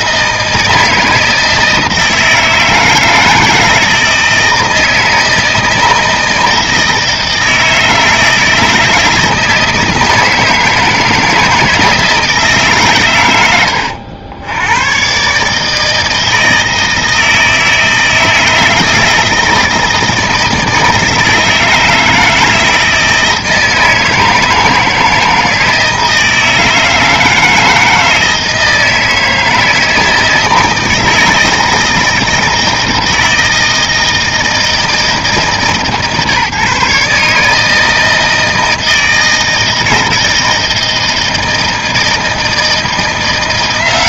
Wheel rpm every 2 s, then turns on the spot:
160, 160, 160, 160, 160, 160, 150, 100, 160, 160, 160, 160, 160, 160, 160, 160, 160, 160, 150, 160, 160, 160.
none